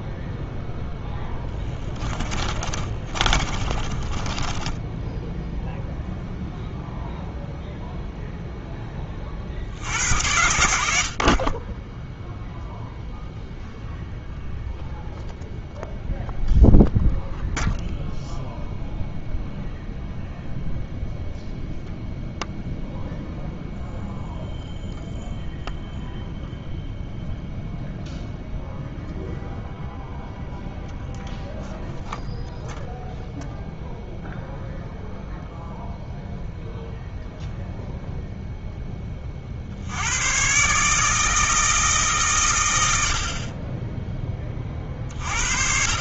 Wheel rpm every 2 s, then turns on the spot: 0, 30, 10, 0, 10, 60, 0, 0, 0, 0, 0, 0, 0, 0, 0, 0, 0, 0, 0, 0, 130, 100, 30.
2-6